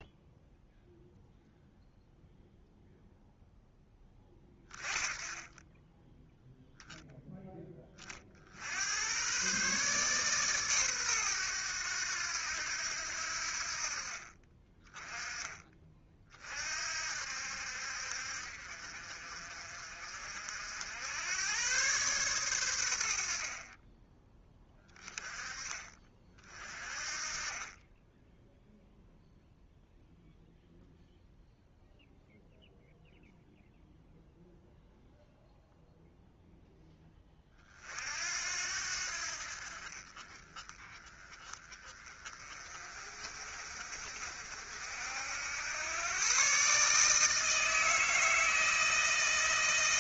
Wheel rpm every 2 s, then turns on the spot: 0, 0, 20, 0, 100, 120, 80, 20, 60, 50, 80, 70, 20, 30, 0, 0, 0, 0, 10, 70, 20, 40, 70, 150, 160.
none